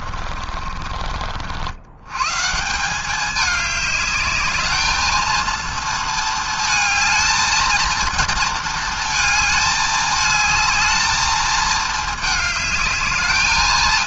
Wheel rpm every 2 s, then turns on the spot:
30, 100, 210, 230, 230, 210, 220.
0-2